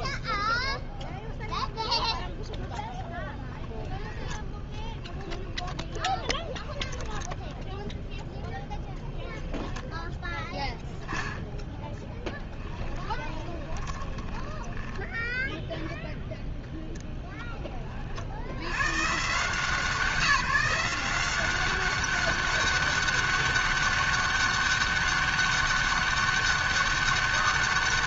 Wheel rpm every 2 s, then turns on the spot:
0, 10, 10, 0, 10, 0, 10, 0, 10, 160, 190, 200, 200, 200.
12-14 16-18